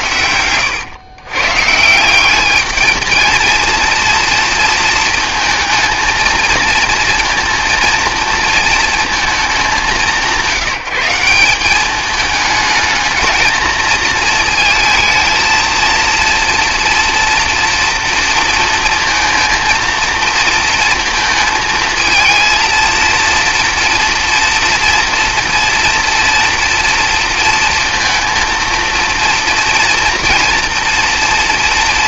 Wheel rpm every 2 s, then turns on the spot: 100, 210, 230, 230, 230, 170, 220, 230, 230, 230, 230, 230, 240, 230, 230, 230.
none